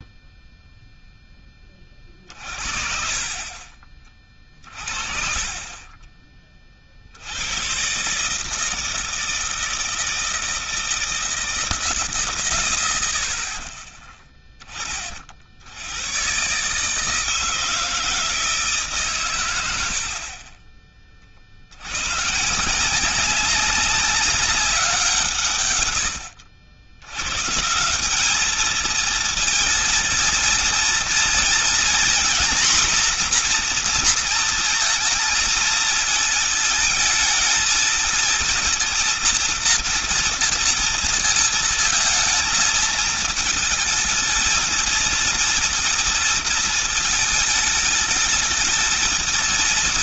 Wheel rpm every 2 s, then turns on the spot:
0, 40, 40, 40, 160, 160, 100, 20, 140, 150, 40, 160, 180, 90, 220, 230, 250, 230, 220, 230, 230, 220, 230, 220, 220.
20-22